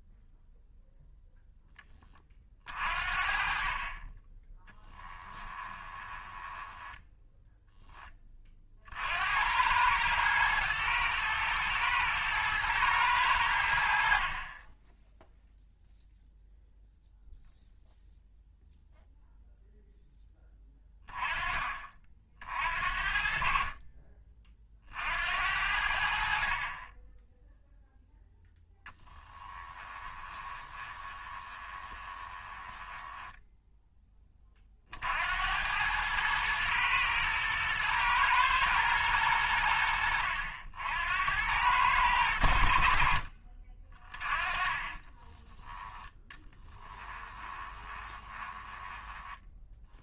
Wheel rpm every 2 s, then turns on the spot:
0, 40, 20, 10, 50, 110, 110, 10, 0, 0, 10, 50, 50, 30, 10, 20, 10, 40, 110, 110, 70, 70, 30, 20, 20.
4-8 30-34 44-50